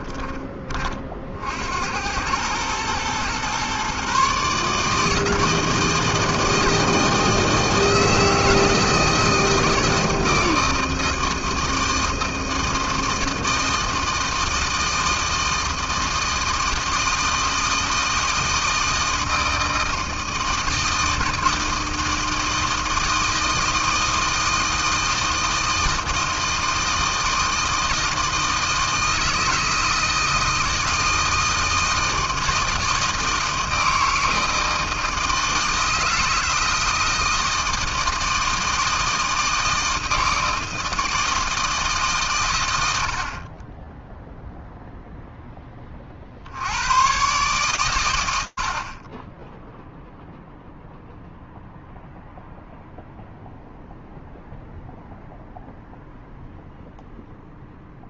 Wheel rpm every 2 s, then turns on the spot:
20, 110, 150, 160, 160, 160, 160, 160, 160, 160, 160, 160, 160, 160, 160, 160, 160, 160, 160, 160, 160, 90, 0, 80, 70, 0, 0, 0, 0.
none